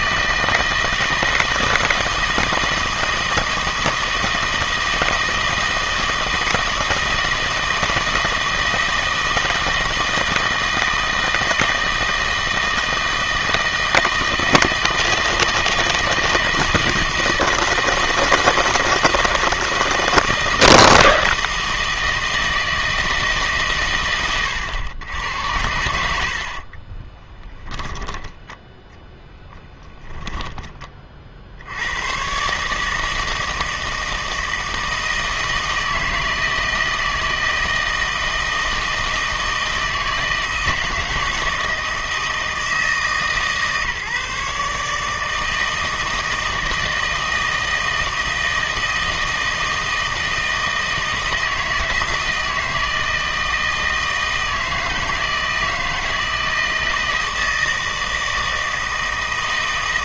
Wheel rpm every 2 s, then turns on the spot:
160, 160, 160, 160, 160, 160, 160, 160, 160, 160, 160, 160, 110, 40, 10, 20, 150, 160, 160, 160, 160, 160, 150, 160, 160, 160, 160, 160, 160, 160.
26-28